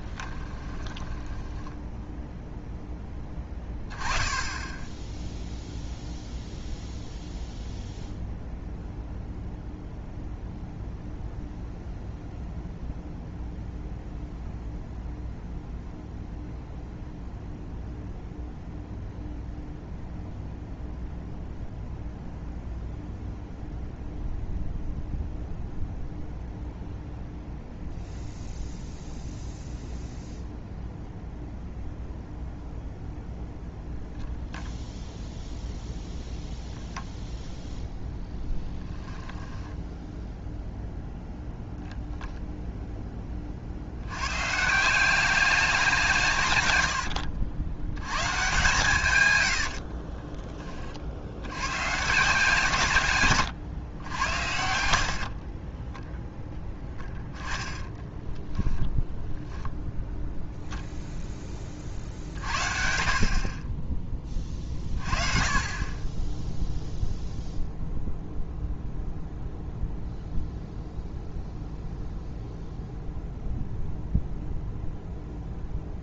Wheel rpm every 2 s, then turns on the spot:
20, 0, 10, 0, 0, 0, 0, 0, 0, 0, 0, 0, 0, 0, 0, 0, 0, 0, 0, 10, 0, 10, 150, 100, 140, 30, 150, 80, 20, 10, 0, 50, 30, 0, 0, 0, 0, 0.
0-2 38-40 46-48